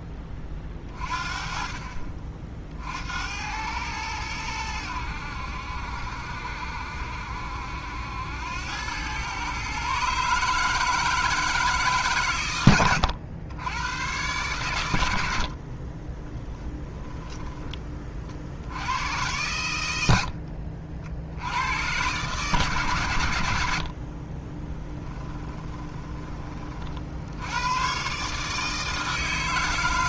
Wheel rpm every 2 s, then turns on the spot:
30, 60, 90, 70, 100, 160, 100, 100, 10, 90, 50, 140, 10, 40, 150.
12-14 16-18 24-26